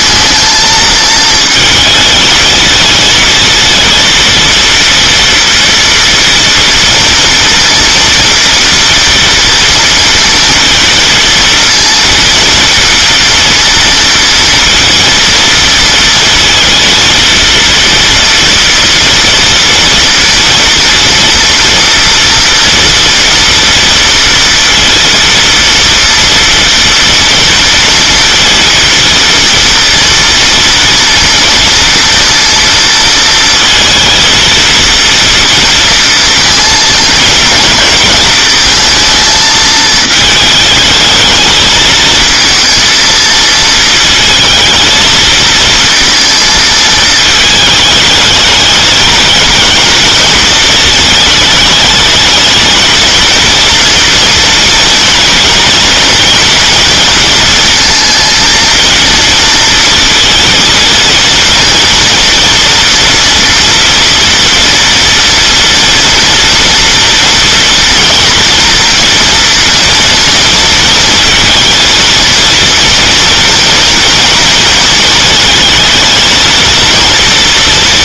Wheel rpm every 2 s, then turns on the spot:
220, 220, 230, 230, 230, 230, 230, 230, 230, 230, 240, 230, 230, 230, 230, 230, 230, 230, 230, 230, 220, 230, 230, 230, 210, 220, 220, 230, 230, 220, 230, 230, 230, 230, 230, 230, 230, 230, 230.
none